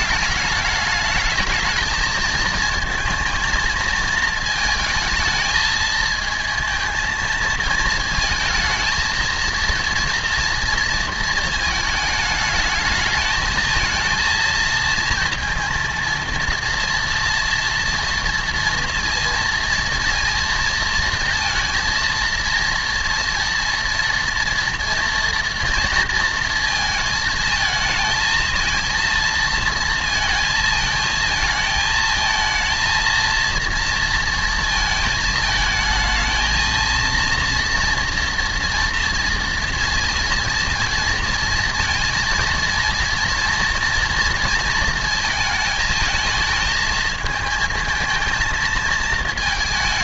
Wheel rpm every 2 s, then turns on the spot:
210, 230, 220, 230, 220, 230, 220, 220, 230, 230, 230, 230, 230, 230, 230, 220, 220, 220, 220, 230, 230, 230, 230, 220, 230.
none